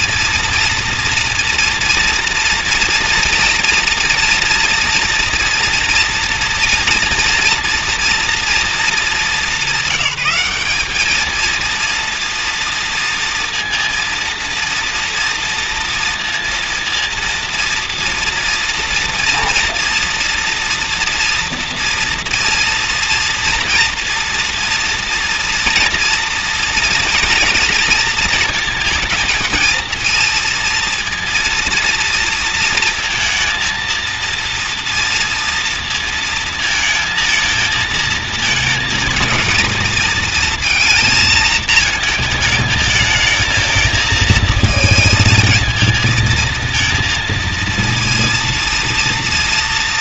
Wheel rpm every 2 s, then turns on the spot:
230, 230, 230, 230, 220, 200, 230, 230, 230, 230, 230, 230, 230, 230, 220, 230, 230, 230, 220, 220, 230, 220, 230, 230, 230.
none